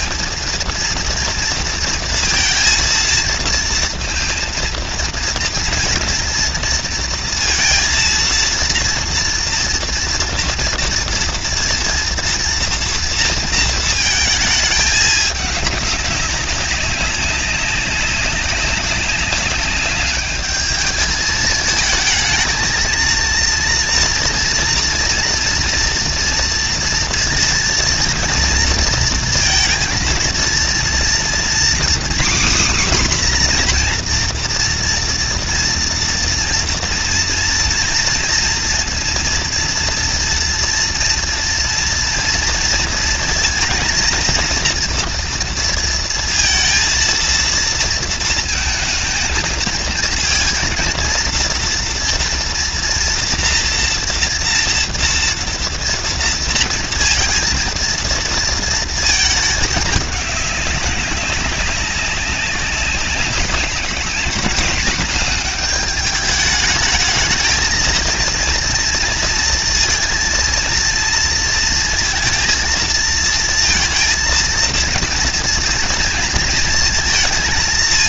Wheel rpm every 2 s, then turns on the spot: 230, 230, 230, 230, 230, 230, 230, 210, 190, 200, 210, 230, 230, 230, 230, 240, 270, 230, 240, 230, 230, 230, 230, 230, 220, 230, 230, 230, 230, 220, 200, 190, 220, 220, 230, 230, 230, 230, 220.
none